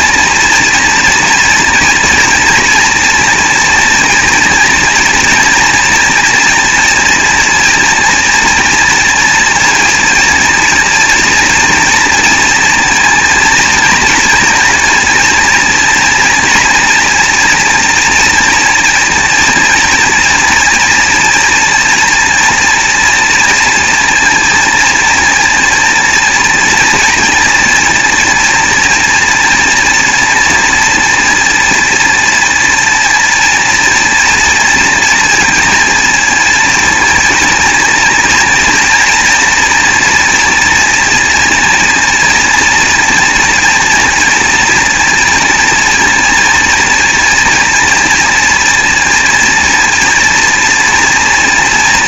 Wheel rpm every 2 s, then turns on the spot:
230, 230, 230, 230, 230, 230, 230, 230, 230, 230, 230, 230, 230, 240, 240, 230, 230, 240, 230, 230, 230, 230, 230, 230, 230, 230.
none